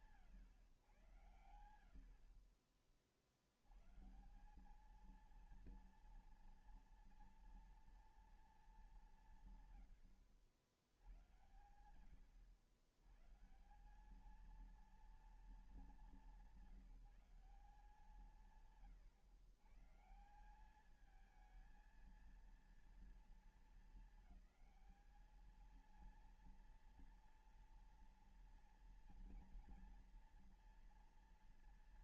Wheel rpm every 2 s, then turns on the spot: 140, 50, 200, 230, 210, 90, 120, 220, 190, 140, 190, 230, 220, 230, 230, 220.
2-4